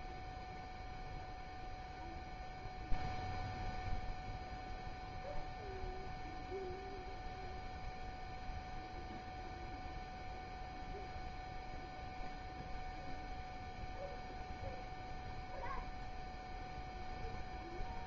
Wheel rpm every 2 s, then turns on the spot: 0, 0, 0, 0, 0, 0, 0, 0, 0.
none